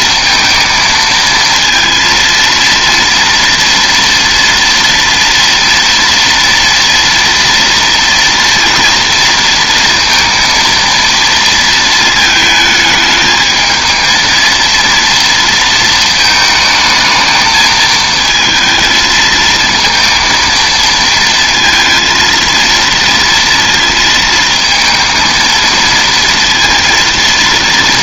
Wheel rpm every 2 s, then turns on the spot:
230, 230, 230, 230, 230, 230, 220, 230, 220, 220, 230, 230, 230, 230.
none